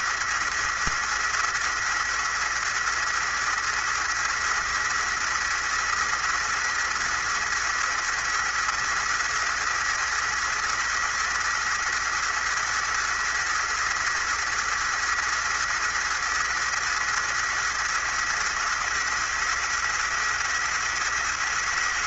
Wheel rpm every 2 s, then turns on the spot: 230, 230, 230, 230, 220, 220, 220, 220, 220, 230, 230.
none